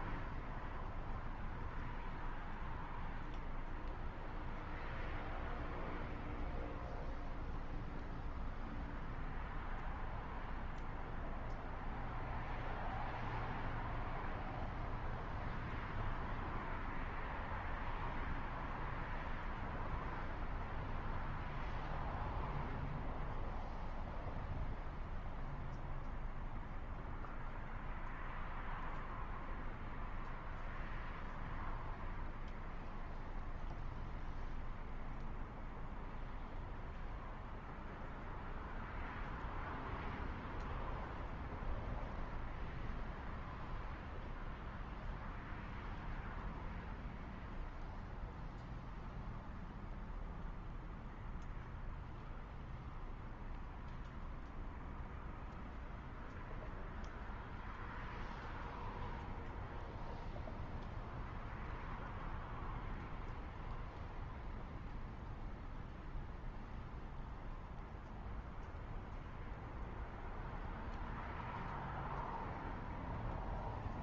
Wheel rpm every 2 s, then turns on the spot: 0, 0, 0, 0, 0, 0, 0, 0, 0, 0, 0, 0, 0, 0, 0, 0, 0, 0, 0, 0, 0, 0, 0, 0, 0, 0, 0, 0, 0, 0, 0, 0, 0, 0, 0, 0, 0.
none